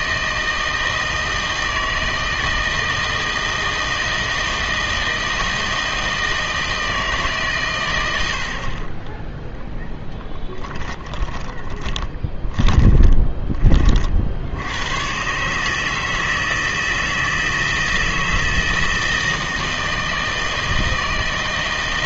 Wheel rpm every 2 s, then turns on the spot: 160, 160, 160, 160, 40, 20, 20, 90, 160, 160, 160.
10-14